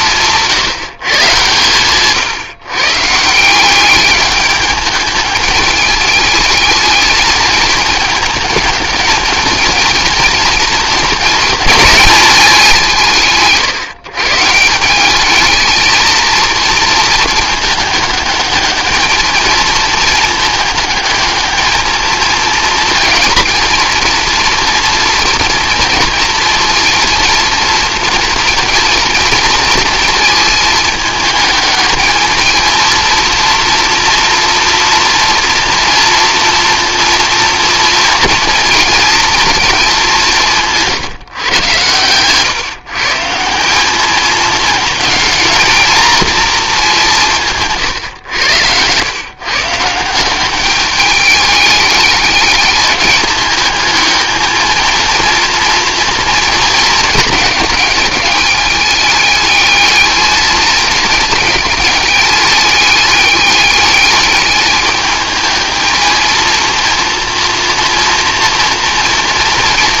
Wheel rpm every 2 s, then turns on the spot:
170, 130, 210, 220, 220, 230, 190, 170, 230, 210, 220, 230, 230, 230, 230, 220, 230, 230, 230, 230, 170, 140, 220, 220, 100, 200, 200, 220, 230, 210, 210, 210, 210, 230, 230.
none